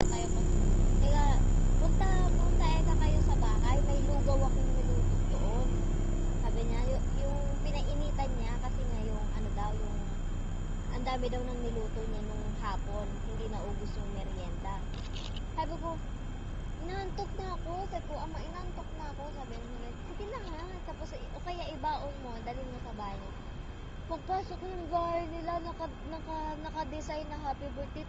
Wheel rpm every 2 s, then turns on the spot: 0, 0, 0, 0, 0, 0, 0, 0, 0, 0, 0, 0, 0, 0.
none